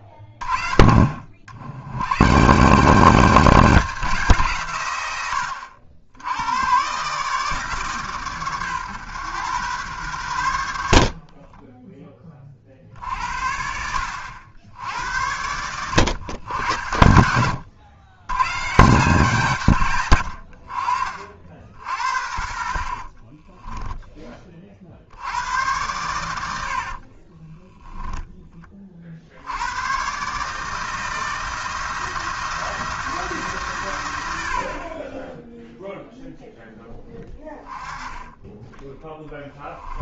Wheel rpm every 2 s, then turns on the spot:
50, 200, 110, 150, 120, 50, 60, 90, 80, 170, 50, 30, 80, 40, 40, 160, 170, 30, 10, 20.
10-12 22-24 26-28 38-40